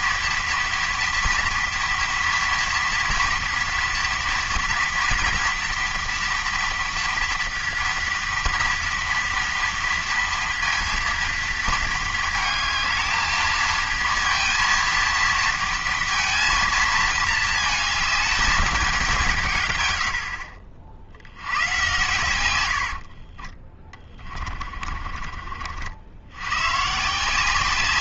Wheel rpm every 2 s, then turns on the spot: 230, 230, 230, 230, 230, 230, 220, 230, 230, 220, 60, 90, 40, 120.
22-26